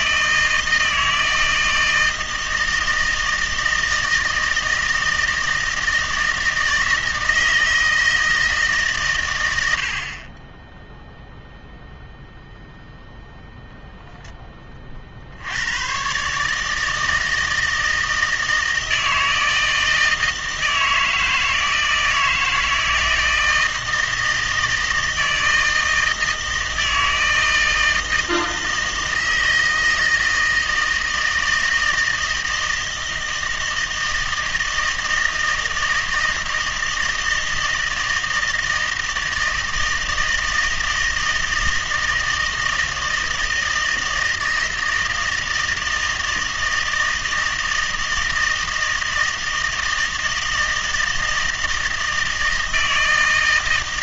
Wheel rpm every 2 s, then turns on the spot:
160, 160, 160, 160, 150, 10, 0, 20, 150, 160, 160, 160, 160, 160, 160, 160, 160, 160, 160, 160, 160, 160, 160, 160, 160, 160, 160.
none